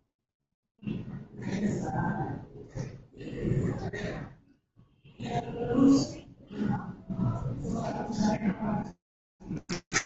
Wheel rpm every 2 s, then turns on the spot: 0, 0, 0, 0, 0.
none